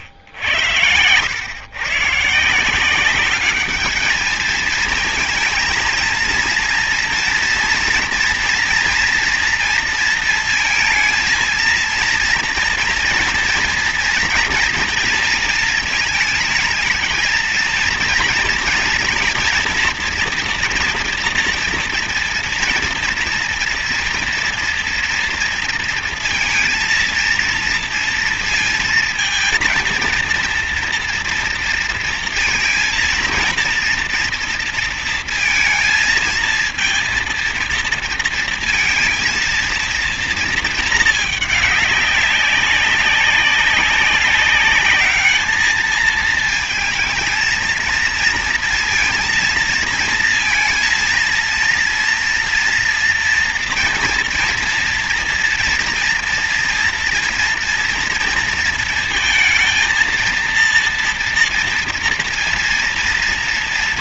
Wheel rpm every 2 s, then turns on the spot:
100, 160, 220, 230, 230, 230, 230, 230, 230, 230, 240, 230, 230, 230, 230, 230, 230, 230, 230, 220, 220, 200, 200, 230, 230, 230, 230, 230, 240, 230, 230, 230.
0-2